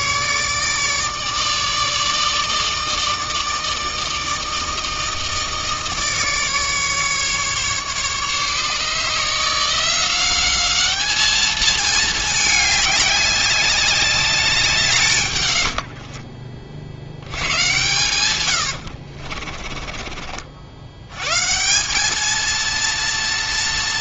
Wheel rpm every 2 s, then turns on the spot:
150, 160, 160, 150, 150, 210, 210, 160, 50, 90, 80, 230.
18-20